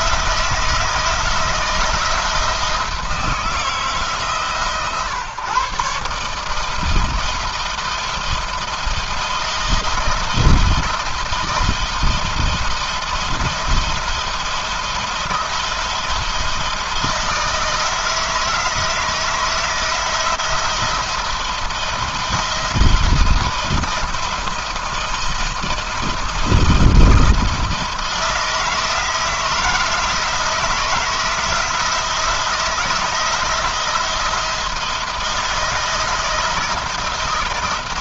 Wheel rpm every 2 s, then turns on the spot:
160, 160, 130, 160, 160, 160, 170, 170, 160, 160, 170, 170, 170, 170, 170, 160, 160, 160, 160.
none